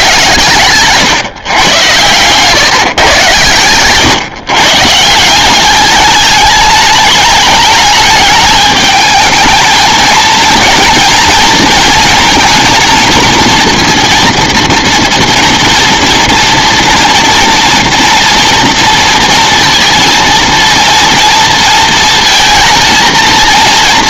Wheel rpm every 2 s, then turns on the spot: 120, 130, 140, 210, 220, 230, 230, 230, 230, 230, 230, 220.
none